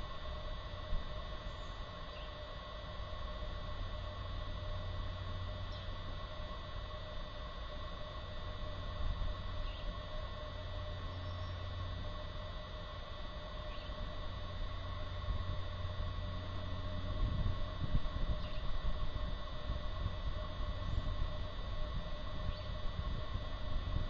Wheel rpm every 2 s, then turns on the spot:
0, 0, 0, 0, 0, 0, 0, 0, 0, 0, 0, 0.
none